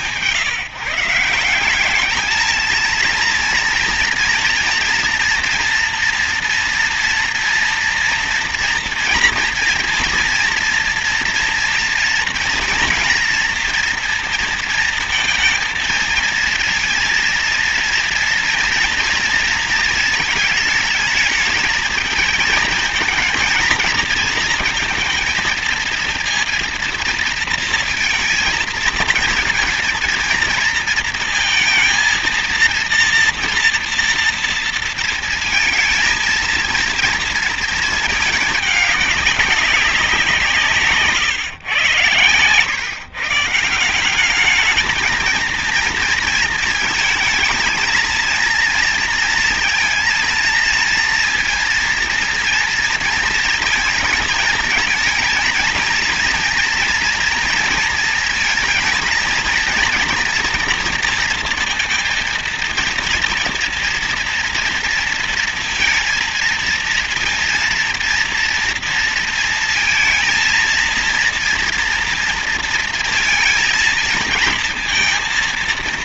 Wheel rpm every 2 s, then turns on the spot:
160, 230, 230, 230, 230, 230, 230, 230, 230, 230, 220, 230, 230, 230, 230, 230, 230, 230, 230, 210, 160, 120, 220, 230, 230, 230, 230, 230, 230, 230, 230, 230, 230, 230, 230, 230, 230, 230.
none